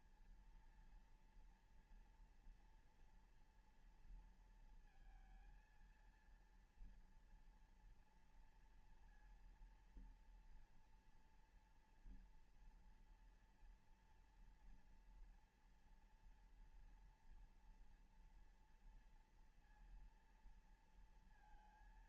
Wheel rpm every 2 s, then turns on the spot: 230, 240, 230, 230, 230, 230, 230, 230, 230, 240, 230.
none